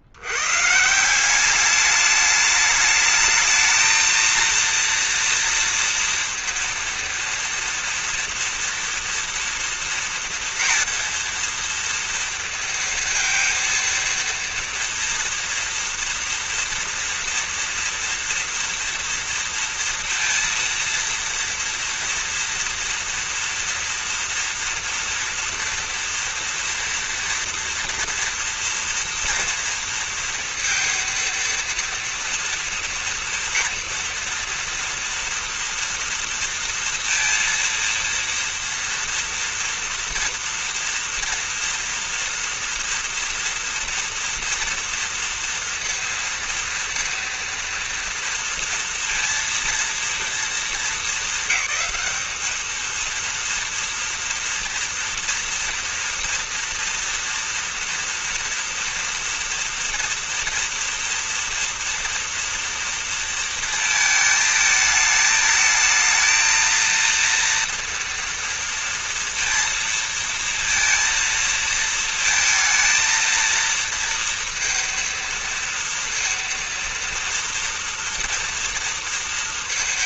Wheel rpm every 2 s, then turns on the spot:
130, 210, 230, 230, 230, 230, 230, 230, 230, 240, 230, 230, 230, 230, 230, 230, 230, 230, 230, 230, 240, 230, 230, 230, 230, 230, 210, 230, 230, 230, 230, 230, 220, 220, 230, 230, 230, 230, 230, 230.
none